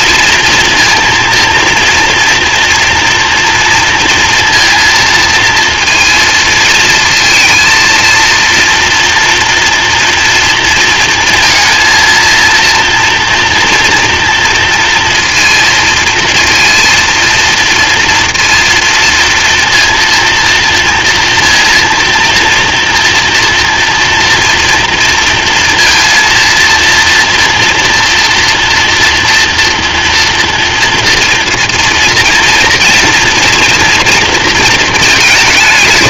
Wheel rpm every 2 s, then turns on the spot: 230, 230, 230, 230, 230, 230, 230, 230, 230, 230, 240, 230, 230, 230, 240, 230, 230, 220.
none